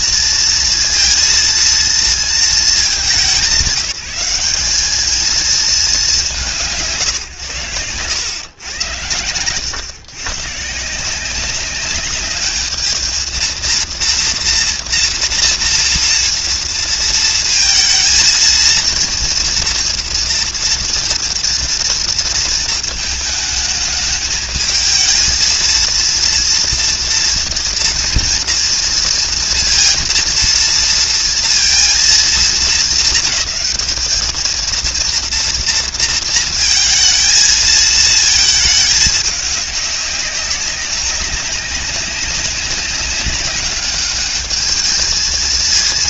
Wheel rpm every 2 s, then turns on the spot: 230, 200, 200, 140, 110, 160, 220, 230, 230, 230, 230, 230, 220, 240, 230, 230, 210, 230, 230, 210, 200, 200, 220.
none